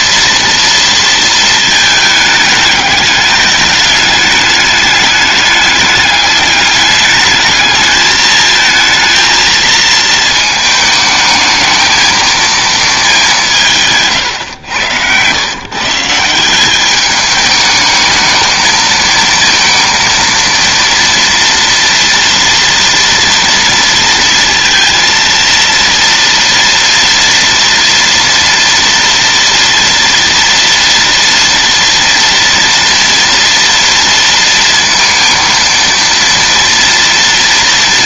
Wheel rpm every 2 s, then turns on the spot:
230, 210, 200, 210, 220, 220, 220, 150, 170, 220, 230, 240, 230, 230, 230, 230, 230, 230, 230.
14-16